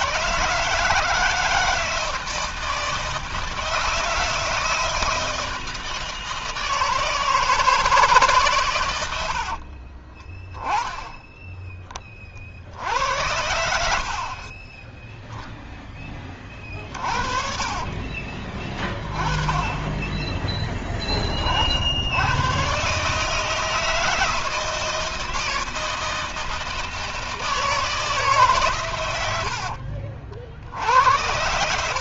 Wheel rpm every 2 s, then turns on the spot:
150, 160, 160, 160, 140, 20, 50, 60, 30, 30, 10, 110, 160, 160, 140, 70.
14-18